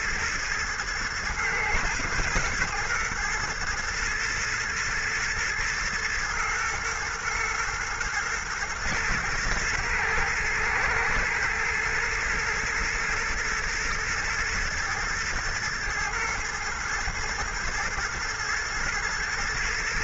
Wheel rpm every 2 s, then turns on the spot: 110, 120, 120, 110, 120, 110, 110, 110, 120, 120.
none